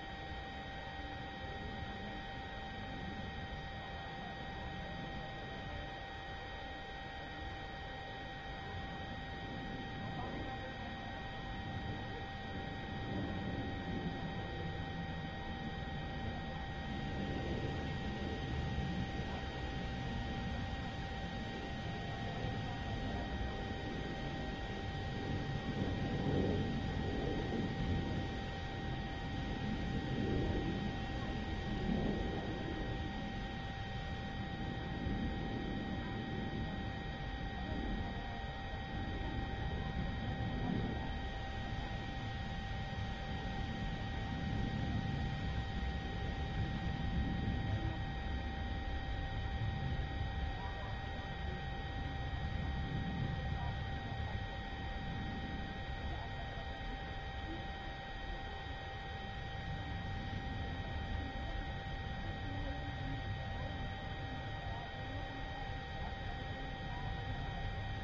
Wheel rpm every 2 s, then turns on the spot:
0, 0, 0, 0, 0, 0, 0, 0, 0, 0, 0, 0, 0, 0, 0, 0, 0, 0, 0, 0, 0, 0, 0, 0, 0, 0, 0, 0, 0, 0, 0, 0, 0, 0.
none